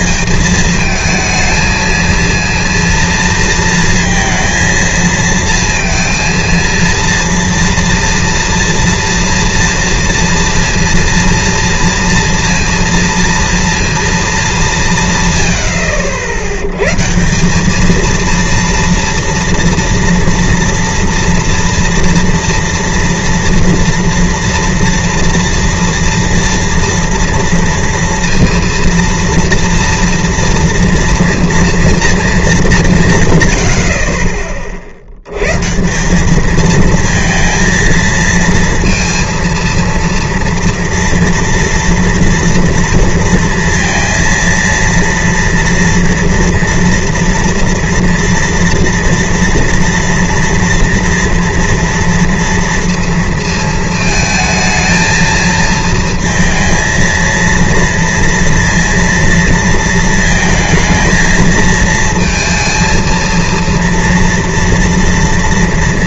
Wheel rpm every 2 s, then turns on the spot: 230, 230, 230, 230, 230, 230, 230, 70, 200, 230, 230, 230, 230, 230, 230, 240, 90, 140, 230, 230, 230, 230, 230, 230, 230, 230, 230, 220, 230, 230, 220, 230, 230.
none